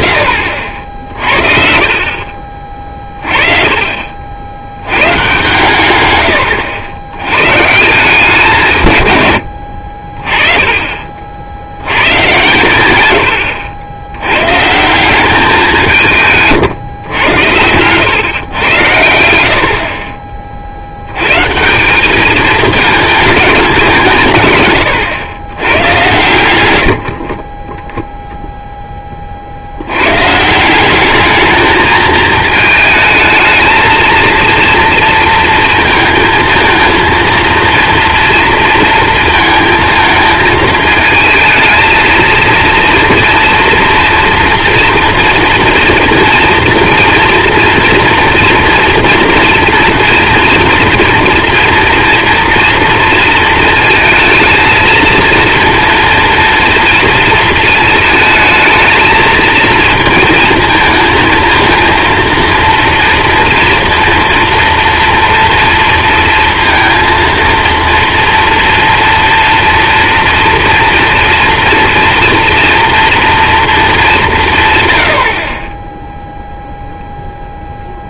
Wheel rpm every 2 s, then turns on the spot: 60, 30, 100, 80, 150, 40, 110, 160, 130, 90, 60, 210, 120, 90, 10, 180, 220, 230, 230, 230, 220, 230, 240, 230, 230, 240, 230, 220, 240, 220, 220, 230, 230, 230, 240, 230, 240, 110, 0.
none